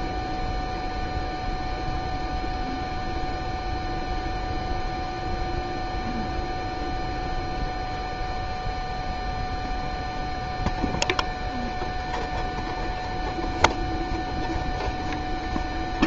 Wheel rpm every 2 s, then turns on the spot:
0, 0, 0, 0, 0, 0, 0, 0.
none